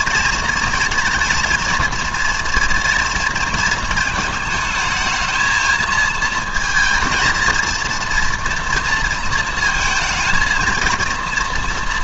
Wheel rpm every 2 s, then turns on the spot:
220, 230, 220, 220, 230, 230.
none